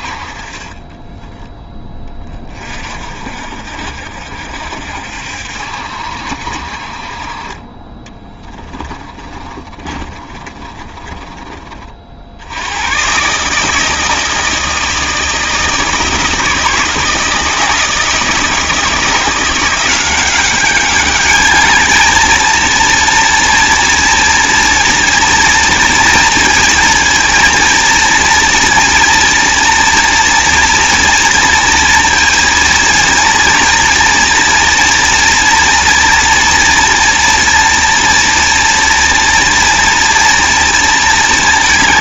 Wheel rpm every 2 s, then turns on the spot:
40, 30, 60, 50, 20, 30, 90, 160, 160, 170, 200, 230, 240, 240, 230, 230, 230, 230, 240, 240, 230.
8-12